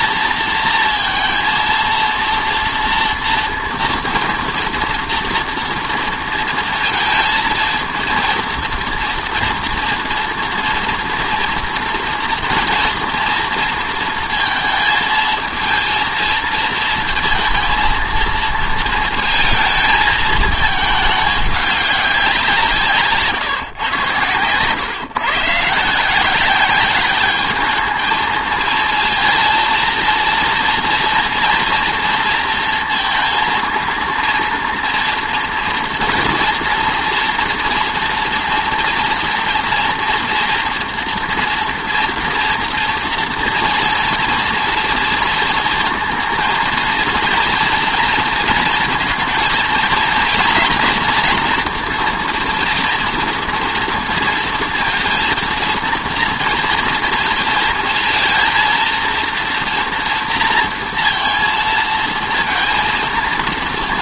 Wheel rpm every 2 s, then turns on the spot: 230, 230, 230, 230, 230, 240, 240, 230, 230, 220, 220, 180, 120, 190, 230, 240, 230, 230, 230, 230, 230, 230, 230, 230, 230, 230, 230, 230, 230, 230, 230, 230.
none